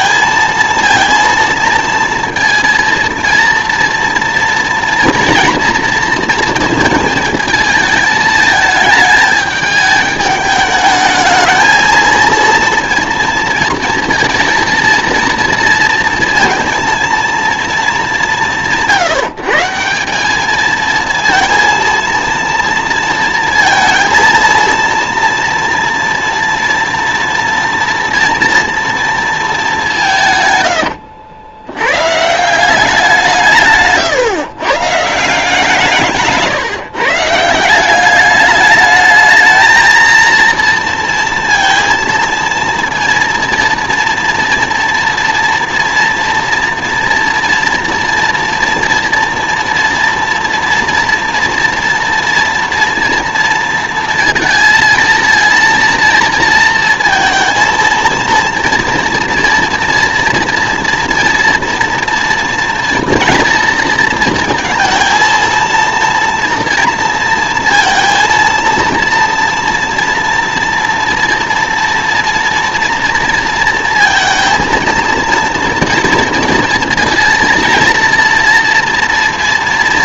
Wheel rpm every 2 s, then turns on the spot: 230, 230, 230, 220, 220, 210, 230, 230, 230, 180, 220, 230, 230, 230, 230, 130, 180, 140, 150, 210, 230, 230, 230, 230, 230, 230, 230, 230, 230, 230, 230, 230, 220, 230, 230, 230, 230, 230, 230, 230.
none